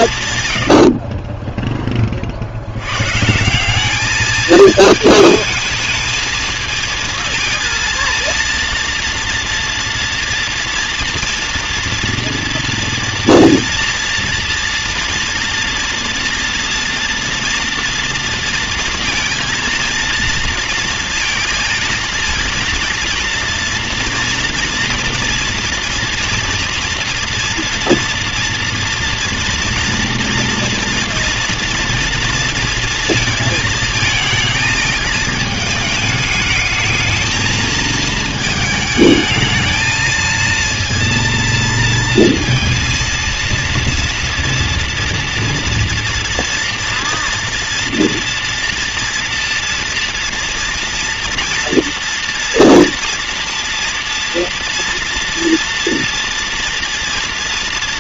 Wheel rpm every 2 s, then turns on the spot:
50, 120, 220, 230, 230, 230, 240, 230, 230, 230, 230, 230, 230, 240, 230, 230, 230, 220, 220, 220, 230, 230, 230, 230, 240, 240, 230, 230, 240.
none